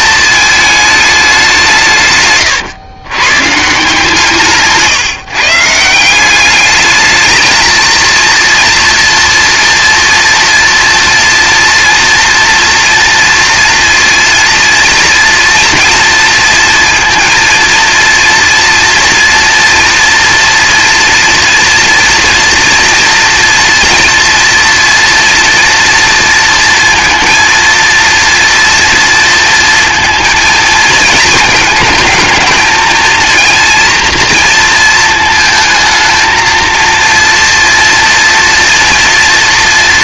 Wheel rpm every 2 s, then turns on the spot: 220, 110, 140, 210, 240, 230, 230, 230, 230, 230, 230, 230, 230, 230, 230, 220, 220, 220, 230, 230.
none